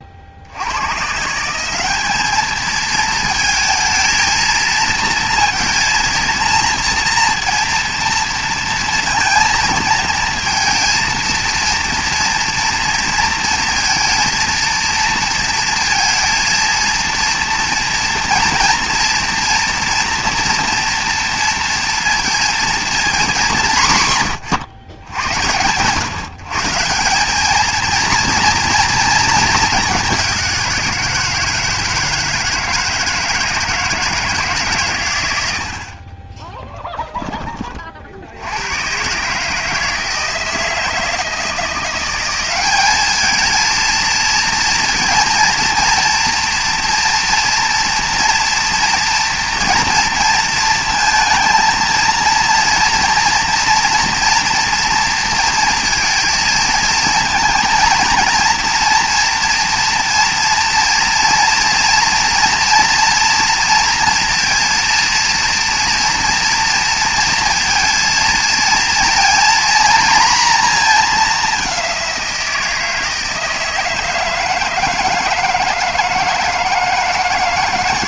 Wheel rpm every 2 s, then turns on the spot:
130, 220, 230, 230, 230, 230, 230, 230, 230, 230, 230, 220, 100, 180, 230, 170, 160, 120, 10, 130, 160, 210, 230, 230, 230, 230, 230, 230, 230, 230, 240, 240, 230, 230, 230, 220, 160, 160, 160.
none